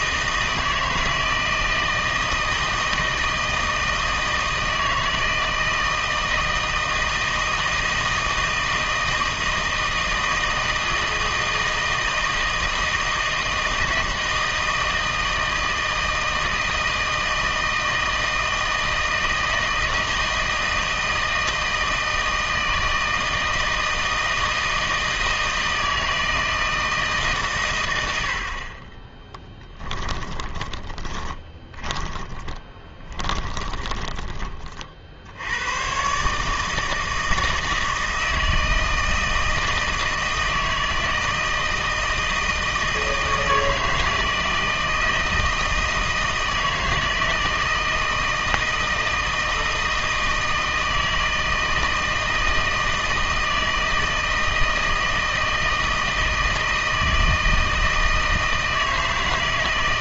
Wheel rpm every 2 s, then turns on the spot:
160, 160, 160, 160, 160, 160, 160, 160, 160, 160, 160, 160, 160, 160, 50, 20, 20, 30, 160, 160, 160, 160, 160, 160, 160, 160, 160, 160, 160, 160.
30-34